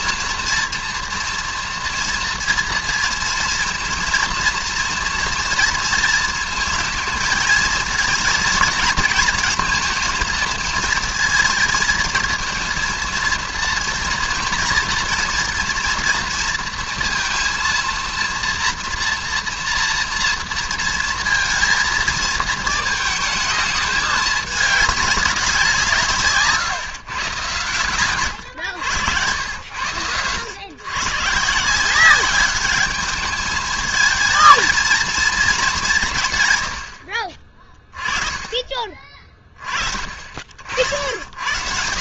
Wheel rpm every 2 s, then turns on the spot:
230, 230, 240, 220, 230, 230, 230, 230, 230, 230, 230, 220, 210, 150, 100, 110, 200, 230, 100, 30, 60.
none